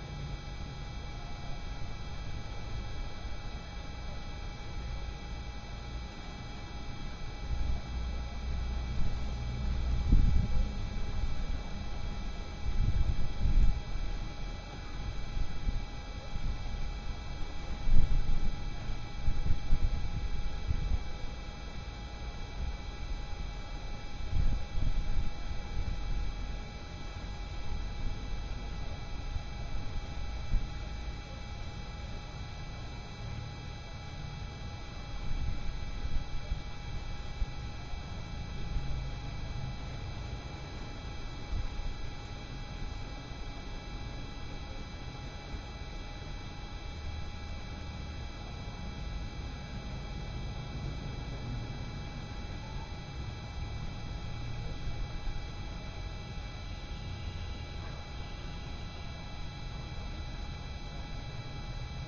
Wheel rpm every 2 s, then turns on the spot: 0, 0, 0, 0, 0, 0, 0, 0, 0, 0, 0, 0, 0, 0, 0, 0, 0, 0, 0, 0, 0, 0, 0, 0, 0, 0, 0, 0, 0, 0, 0.
none